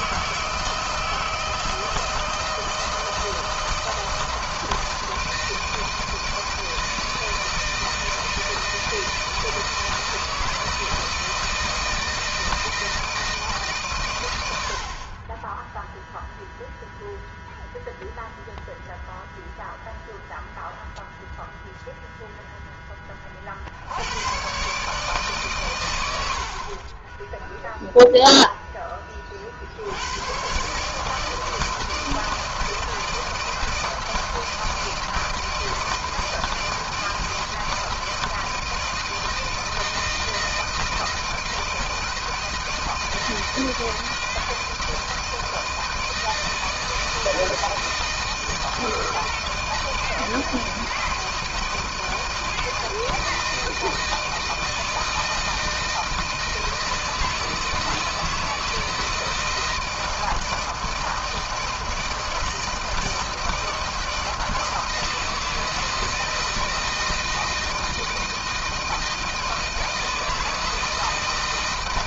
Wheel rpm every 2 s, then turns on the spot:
160, 160, 160, 160, 160, 160, 160, 100, 0, 0, 0, 0, 100, 70, 0, 100, 160, 160, 160, 160, 160, 160, 160, 160, 160, 160, 160, 160, 160, 160, 160, 160, 160, 160, 160, 160.
none